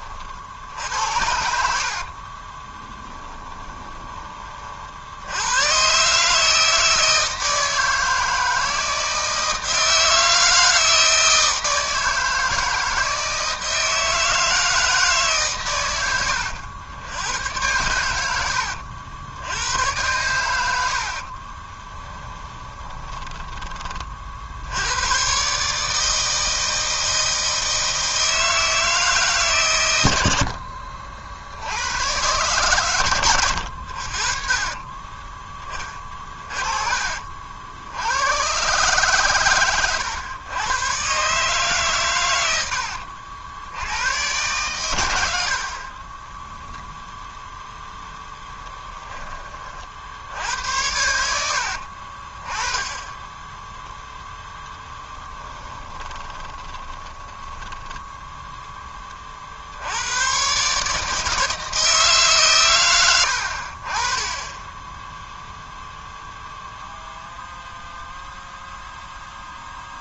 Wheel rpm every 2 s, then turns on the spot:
70, 10, 50, 160, 160, 160, 160, 160, 90, 70, 70, 20, 90, 160, 160, 60, 120, 30, 40, 130, 120, 70, 100, 0, 20, 90, 20, 10, 20, 20, 150, 120, 10, 0, 0.
0-4 20-24 30-32 34-36 42-44 54-58